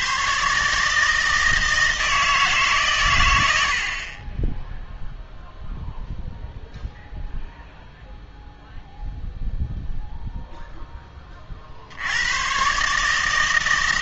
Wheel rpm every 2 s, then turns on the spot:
150, 150, 10, 0, 0, 0, 120.
none